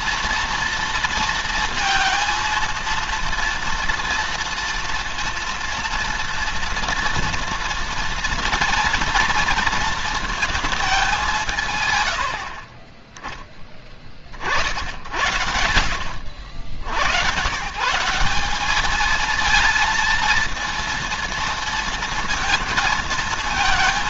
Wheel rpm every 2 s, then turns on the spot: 230, 230, 230, 230, 230, 200, 20, 70, 90, 210, 230, 230.
none